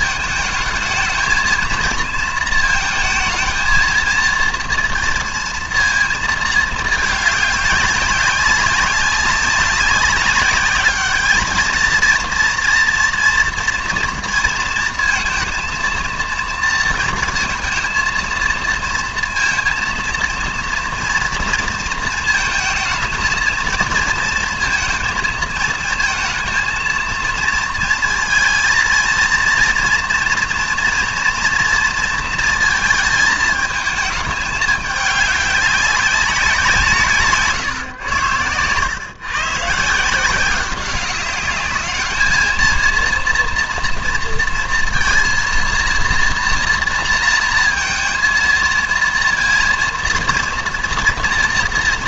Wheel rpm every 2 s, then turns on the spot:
220, 230, 230, 220, 190, 200, 230, 230, 230, 230, 230, 220, 230, 220, 230, 230, 230, 210, 180, 100, 190, 220, 230, 230, 230, 230.
none